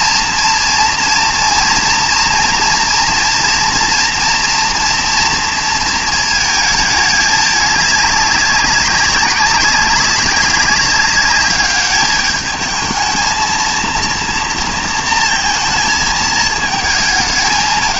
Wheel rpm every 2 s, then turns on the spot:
240, 230, 240, 220, 200, 200, 210, 230, 220.
none